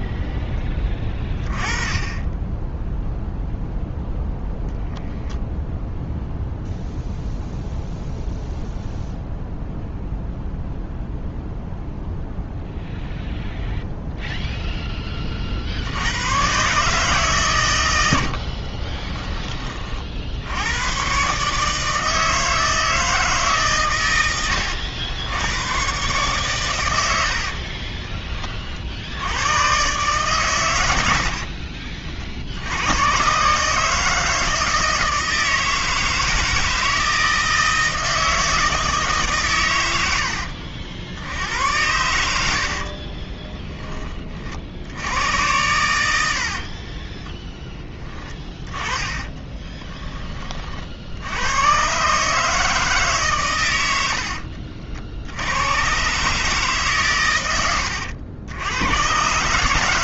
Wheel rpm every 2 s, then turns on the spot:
20, 0, 0, 0, 0, 0, 0, 20, 140, 20, 110, 160, 80, 90, 70, 90, 100, 160, 160, 150, 70, 40, 80, 30, 20, 60, 150, 70, 130, 110.
18-20 42-44 46-50